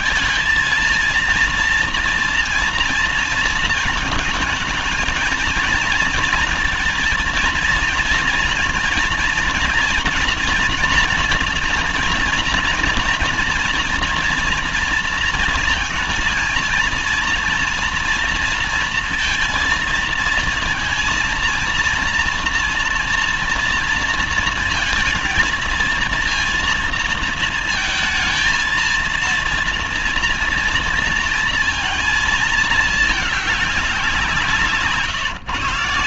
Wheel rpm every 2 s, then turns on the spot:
220, 230, 230, 230, 230, 240, 230, 230, 230, 230, 230, 230, 230, 230, 230, 230, 220, 170.
none